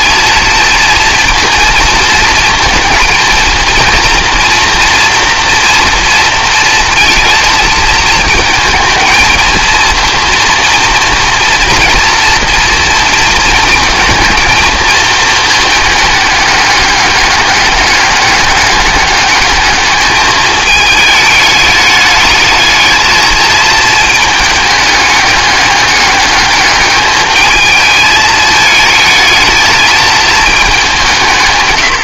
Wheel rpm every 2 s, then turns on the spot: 230, 230, 230, 230, 220, 230, 230, 220, 200, 210, 210, 220, 210, 210, 220, 190.
none